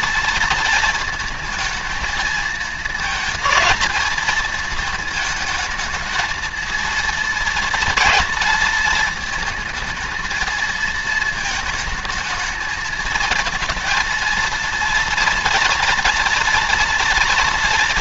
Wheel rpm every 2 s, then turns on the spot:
230, 220, 220, 230, 230, 220, 220, 230, 230.
none